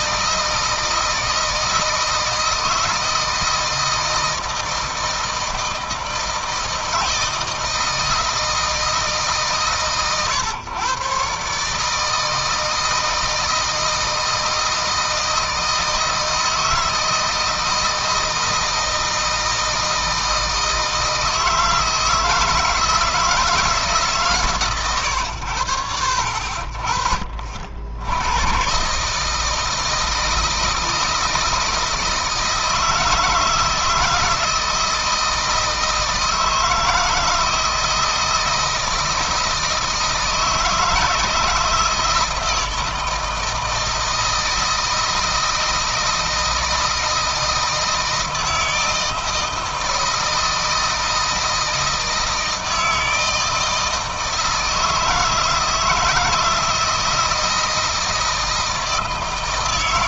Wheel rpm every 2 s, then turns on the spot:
160, 160, 160, 160, 160, 120, 160, 160, 160, 160, 160, 160, 120, 50, 130, 160, 160, 160, 160, 160, 160, 160, 160, 160, 160, 160, 160, 160, 170, 160.
none